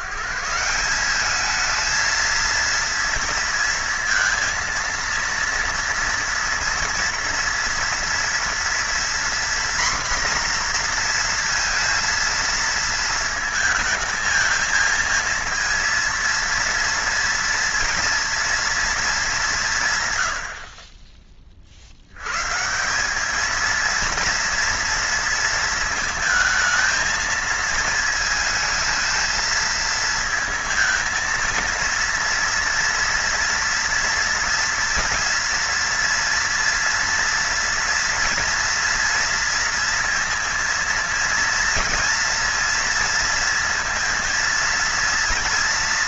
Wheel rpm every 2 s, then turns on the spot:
160, 230, 230, 230, 230, 240, 230, 220, 230, 230, 70, 150, 230, 220, 220, 220, 240, 230, 230, 230, 230, 230, 240.
none